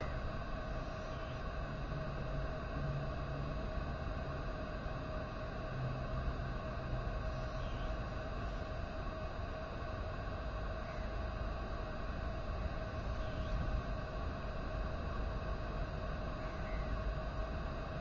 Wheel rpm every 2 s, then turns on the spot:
0, 0, 0, 0, 0, 0, 0, 0, 0.
none